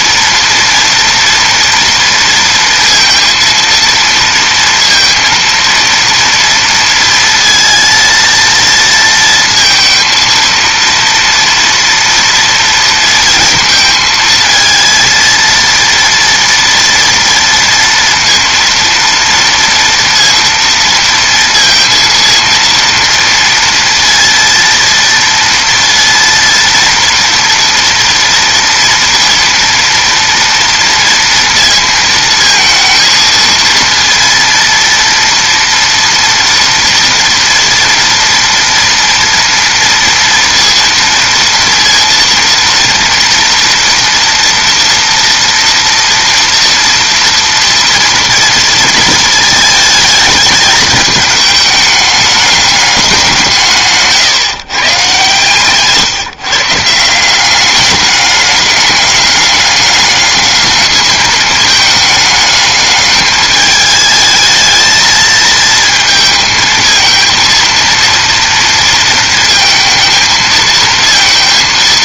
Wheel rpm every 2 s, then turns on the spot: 230, 230, 230, 230, 230, 230, 230, 230, 230, 230, 230, 230, 230, 230, 230, 230, 220, 230, 230, 230, 230, 230, 230, 230, 230, 210, 200, 130, 150, 210, 210, 210, 220, 220, 230, 220.
none